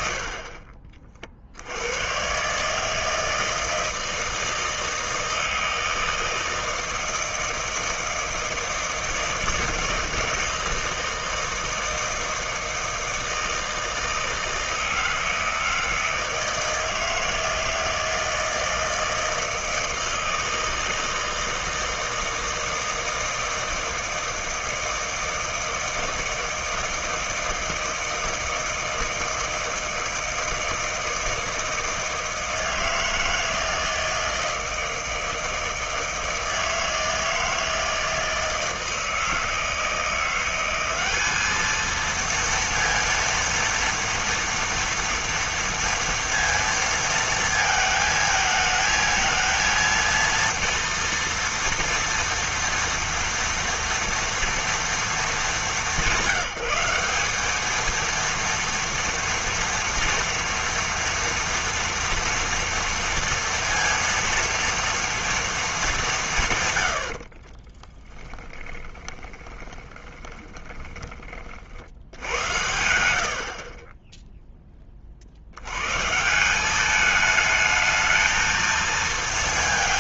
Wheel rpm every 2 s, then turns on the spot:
50, 150, 160, 160, 160, 160, 160, 160, 160, 160, 160, 160, 160, 160, 160, 160, 160, 160, 160, 160, 180, 230, 230, 230, 220, 230, 230, 230, 180, 230, 230, 230, 230, 120, 10, 10, 80, 10, 190, 220.
0-2 68-72